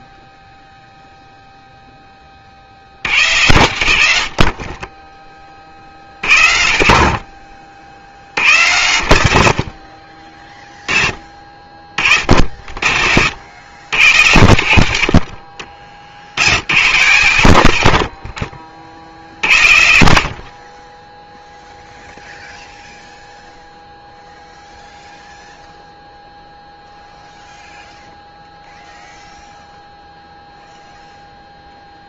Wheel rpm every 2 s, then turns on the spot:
0, 30, 70, 60, 100, 30, 50, 80, 110, 50, 20, 0, 0, 0, 0, 0.
none